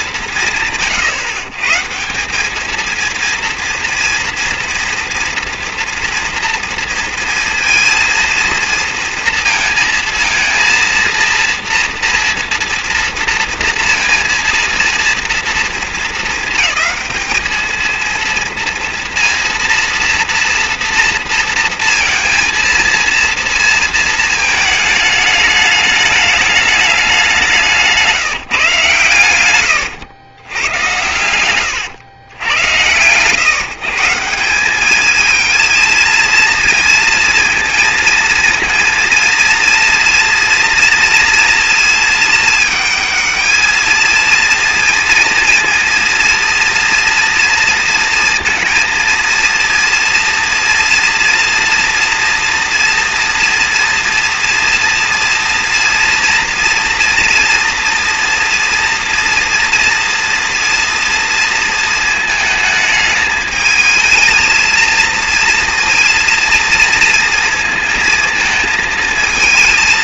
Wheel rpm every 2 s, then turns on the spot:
180, 190, 230, 230, 230, 230, 230, 230, 230, 220, 230, 230, 230, 210, 170, 100, 110, 170, 230, 230, 230, 220, 230, 230, 230, 230, 230, 230, 230, 240, 230, 220, 220, 230, 230.
none